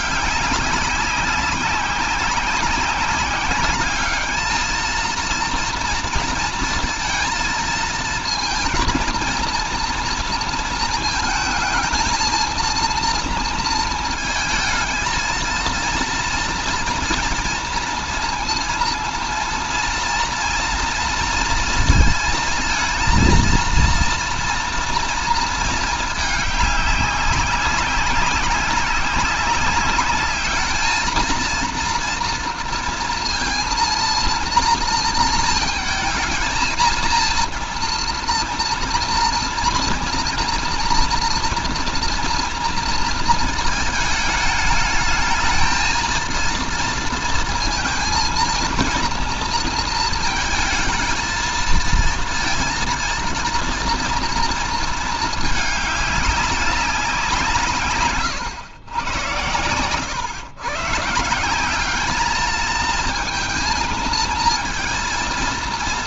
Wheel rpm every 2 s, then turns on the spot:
200, 190, 220, 230, 230, 230, 230, 220, 230, 230, 230, 230, 230, 210, 190, 210, 230, 230, 220, 230, 230, 230, 220, 230, 230, 230, 230, 230, 200, 120, 130, 210, 230.
none